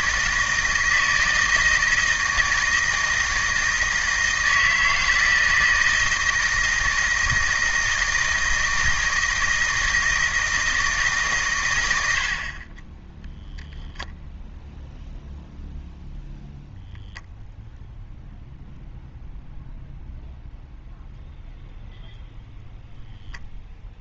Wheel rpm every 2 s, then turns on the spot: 160, 160, 160, 160, 160, 160, 20, 0, 0, 0, 0, 0.
none